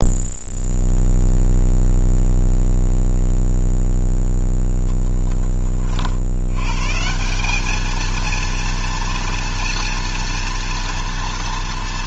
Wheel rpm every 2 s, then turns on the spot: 0, 0, 10, 130, 230, 230.
none